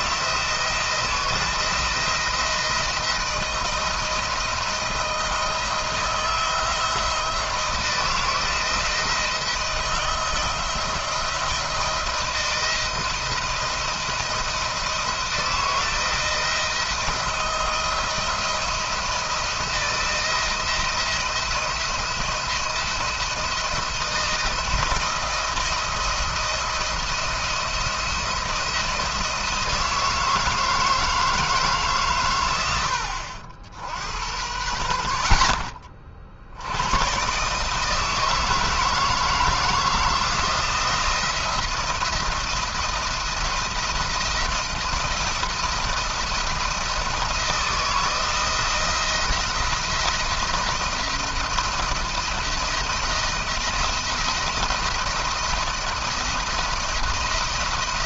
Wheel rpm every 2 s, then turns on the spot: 160, 170, 170, 160, 160, 170, 170, 170, 160, 170, 170, 170, 170, 170, 170, 160, 100, 70, 110, 160, 170, 170, 170, 170, 170, 170, 170, 170, 170.
none